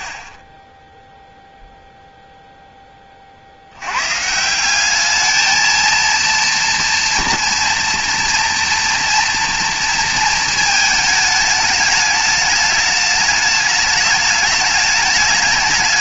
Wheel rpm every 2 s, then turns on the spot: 20, 10, 190, 230, 230, 220, 210, 210.
none